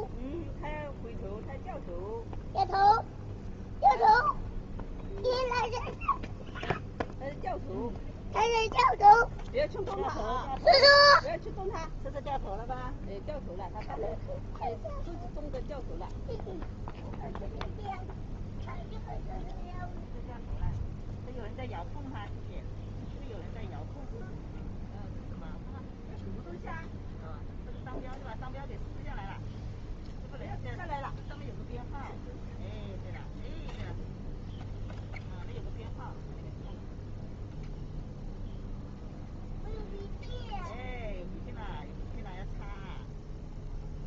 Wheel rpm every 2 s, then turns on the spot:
0, 0, 0, 0, 0, 0, 0, 0, 0, 0, 0, 0, 0, 0, 0, 0, 0, 0, 0, 0, 0, 0.
none